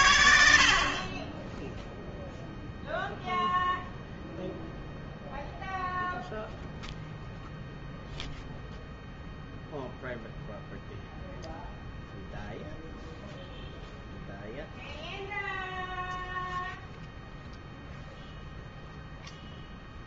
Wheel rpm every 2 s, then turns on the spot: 50, 0, 0, 0, 0, 0, 0, 0, 0, 0.
none